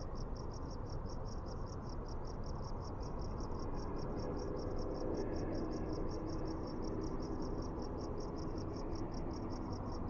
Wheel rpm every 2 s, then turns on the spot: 0, 0, 0, 0, 0.
none